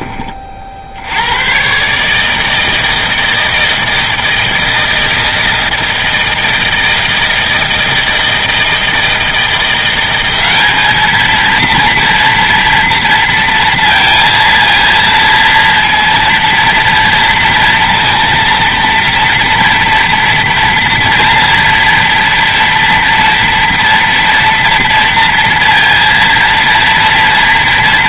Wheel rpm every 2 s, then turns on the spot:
70, 160, 160, 160, 160, 210, 230, 230, 230, 230, 230, 230, 230, 230.
none